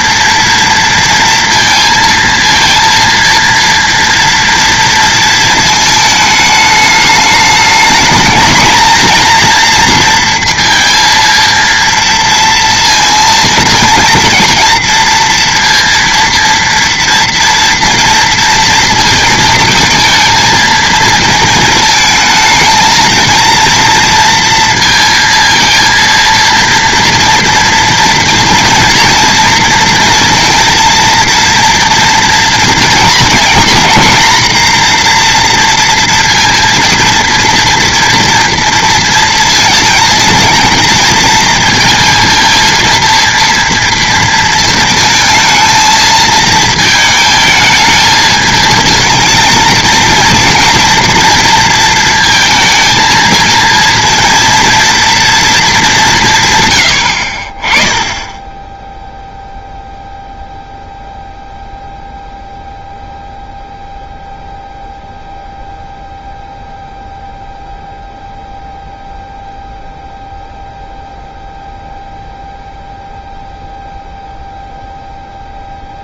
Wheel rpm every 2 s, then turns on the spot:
230, 230, 230, 210, 220, 230, 230, 230, 230, 230, 220, 220, 230, 230, 230, 230, 230, 230, 230, 230, 230, 230, 230, 220, 220, 230, 230, 230, 140, 10, 0, 0, 0, 0, 0, 0, 0, 0.
none